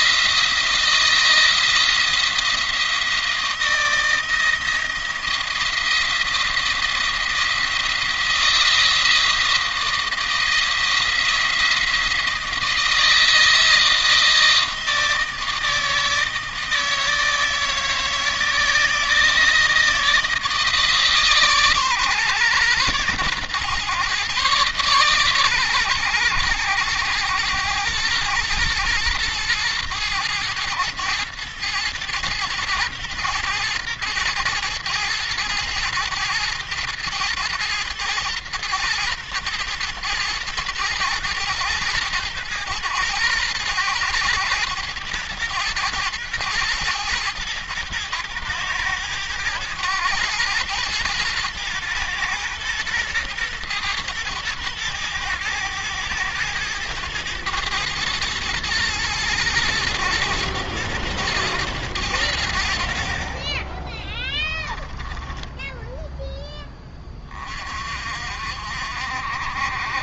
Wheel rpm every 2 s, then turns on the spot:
160, 160, 160, 170, 170, 170, 160, 160, 160, 160, 150, 120, 130, 100, 110, 110, 110, 120, 110, 110, 110, 110, 110, 110, 110, 110, 110, 110, 110, 110, 110, 60, 10, 20, 60.
64-66